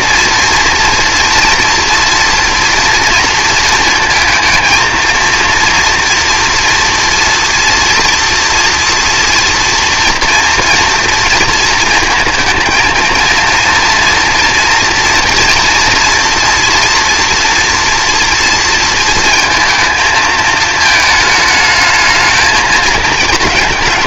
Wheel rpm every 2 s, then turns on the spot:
230, 230, 230, 230, 240, 230, 230, 230, 240, 230, 220, 220.
none